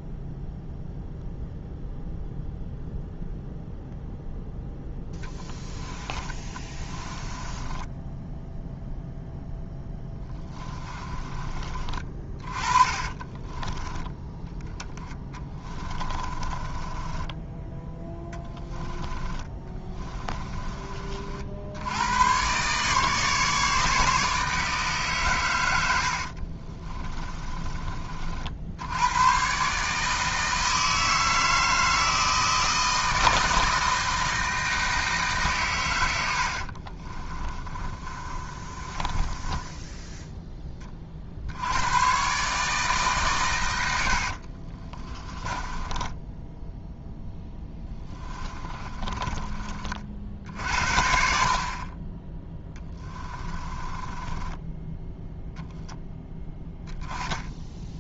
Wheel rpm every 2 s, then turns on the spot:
0, 0, 10, 20, 0, 20, 20, 10, 20, 20, 30, 140, 150, 30, 80, 160, 160, 160, 50, 30, 20, 150, 40, 10, 30, 60, 20, 10, 20.
6-8 10-14 16-20 26-28 36-40 44-50 52-54